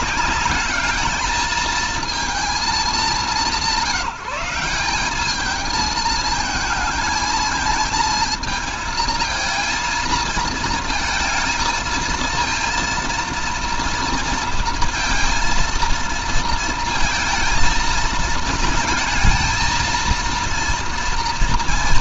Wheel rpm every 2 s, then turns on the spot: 220, 220, 190, 230, 230, 220, 230, 230, 230, 220, 230.
none